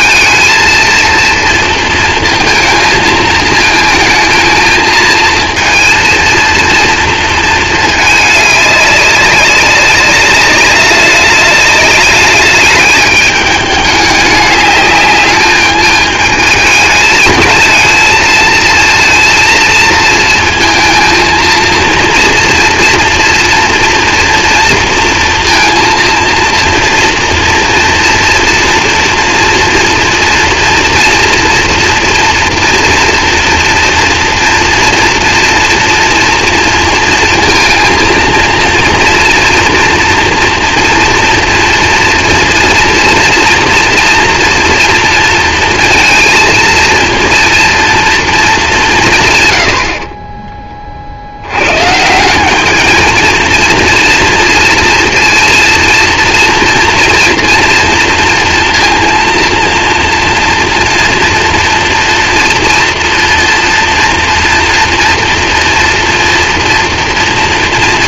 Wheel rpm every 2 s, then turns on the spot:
230, 230, 220, 230, 210, 200, 210, 210, 220, 230, 230, 230, 230, 230, 230, 230, 230, 240, 230, 230, 230, 230, 230, 230, 210, 20, 210, 230, 230, 230, 240, 230, 240, 230.
none